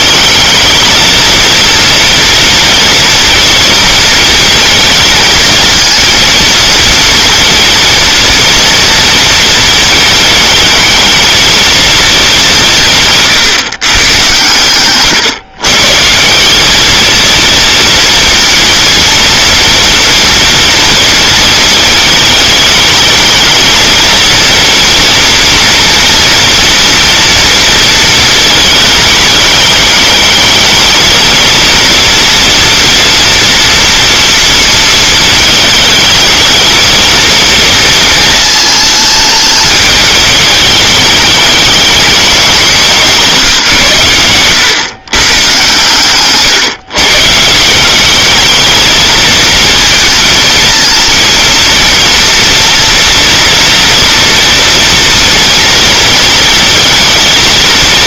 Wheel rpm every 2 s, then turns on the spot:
220, 230, 220, 230, 230, 220, 150, 120, 210, 230, 230, 220, 230, 240, 220, 220, 230, 230, 220, 220, 210, 190, 120, 140, 220, 230, 230, 230, 220.
none